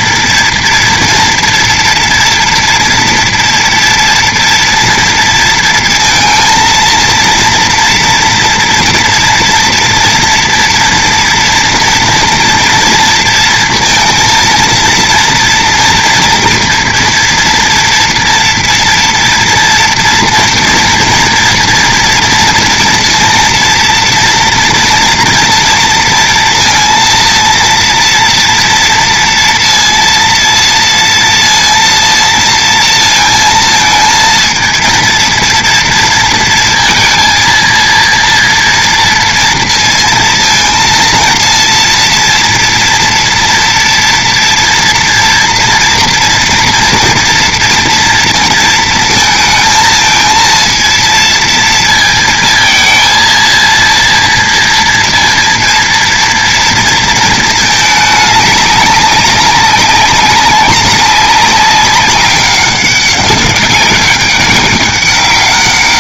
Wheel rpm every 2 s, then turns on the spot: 230, 230, 230, 230, 240, 230, 240, 230, 230, 230, 240, 230, 230, 230, 230, 230, 230, 230, 230, 230, 230, 230, 230, 230, 230, 230, 230, 230, 230, 200, 200, 200, 200.
none